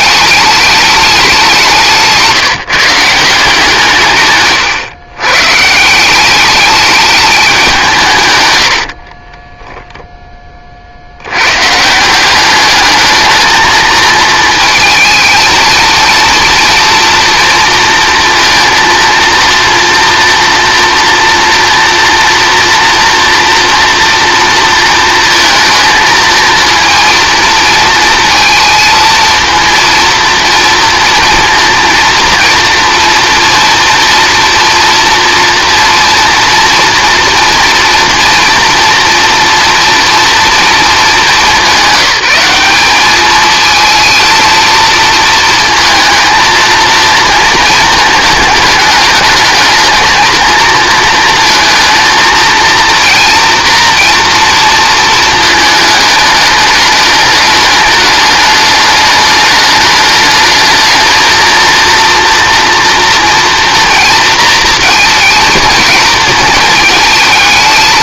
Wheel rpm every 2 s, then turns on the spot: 210, 170, 140, 210, 90, 30, 210, 220, 230, 230, 230, 230, 230, 230, 230, 230, 240, 240, 230, 230, 230, 200, 230, 230, 220, 230, 230, 230, 210, 210, 220, 230, 230, 220.
8-10